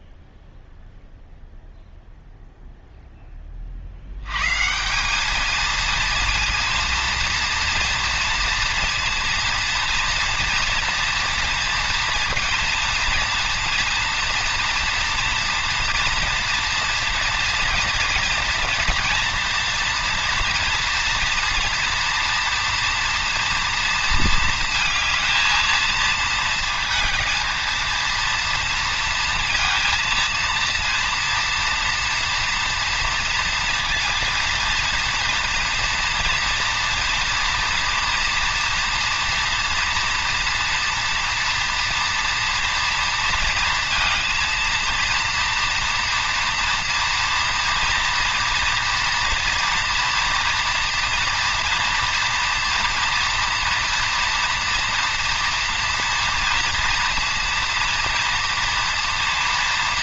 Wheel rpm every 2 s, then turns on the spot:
0, 0, 150, 230, 230, 240, 230, 230, 230, 230, 230, 240, 230, 230, 230, 230, 230, 230, 230, 240, 230, 240, 230, 230, 230, 230, 230, 240, 230, 230.
none